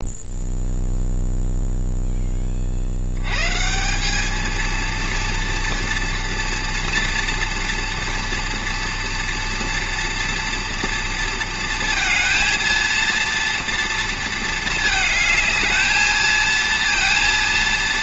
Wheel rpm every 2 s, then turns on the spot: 0, 40, 220, 230, 230, 230, 230, 220, 220.
none